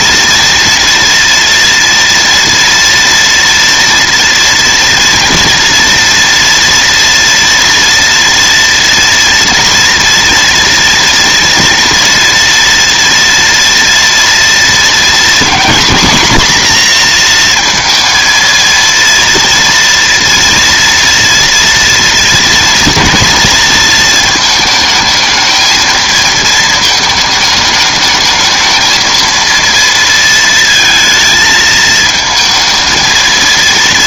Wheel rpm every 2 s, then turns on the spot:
230, 230, 240, 230, 230, 230, 230, 230, 240, 230, 230, 230, 220, 220, 220, 230, 220.
none